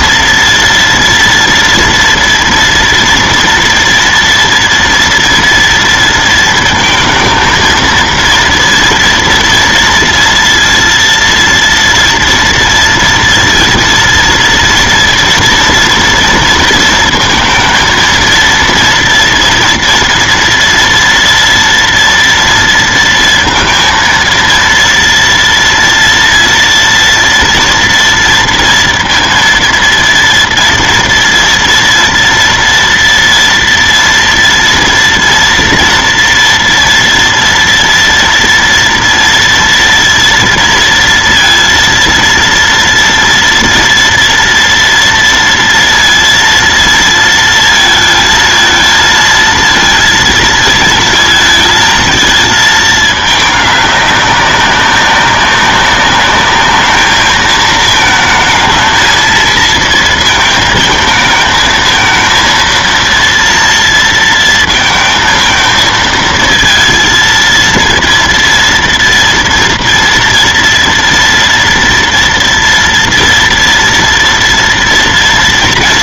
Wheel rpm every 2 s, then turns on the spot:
230, 230, 230, 220, 230, 230, 230, 230, 230, 230, 230, 230, 230, 230, 230, 230, 230, 230, 230, 230, 230, 230, 230, 230, 220, 230, 220, 190, 210, 220, 220, 230, 230, 230, 230, 230, 230, 230.
none